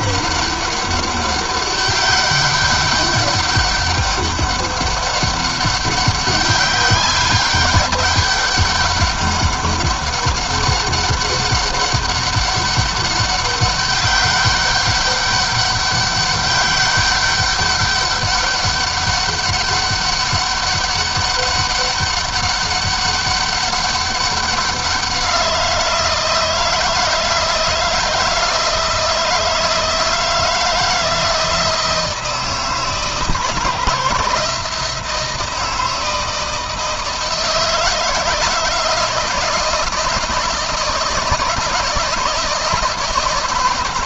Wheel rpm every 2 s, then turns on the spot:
200, 200, 200, 190, 200, 200, 200, 200, 200, 200, 200, 200, 180, 160, 160, 160, 160, 160, 160, 160, 160, 160.
none